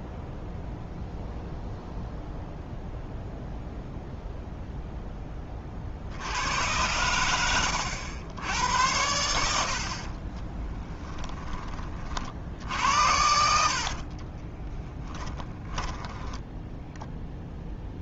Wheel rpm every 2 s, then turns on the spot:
0, 0, 0, 110, 90, 20, 70, 10, 0.
10-16